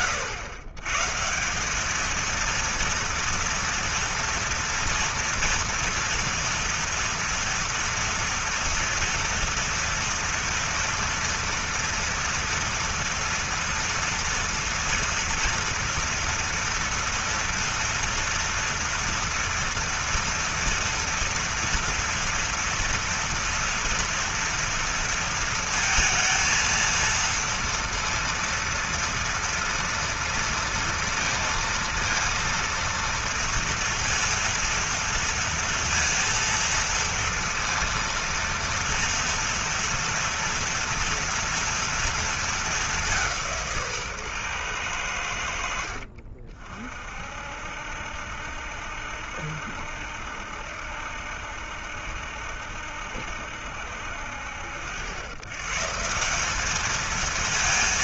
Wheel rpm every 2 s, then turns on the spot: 120, 230, 230, 230, 230, 240, 230, 230, 230, 230, 230, 230, 230, 230, 230, 230, 230, 230, 230, 230, 230, 200, 110, 50, 60, 70, 70, 100, 220.
none